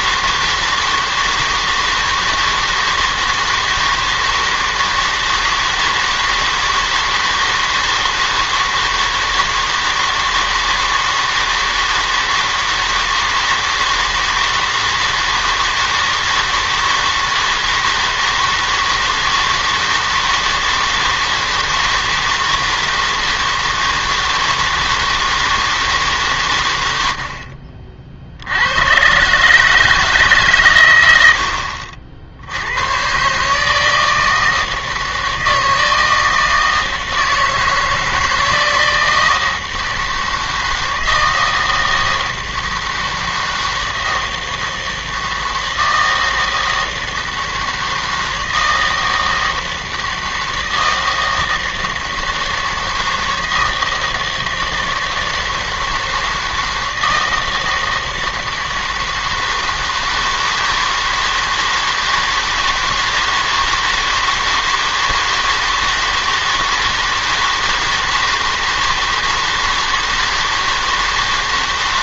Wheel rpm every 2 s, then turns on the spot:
160, 160, 160, 160, 160, 160, 160, 160, 160, 160, 160, 160, 160, 130, 80, 140, 80, 160, 160, 160, 160, 160, 160, 160, 160, 160, 160, 160, 160, 160, 160, 160, 160, 160, 160, 160.
none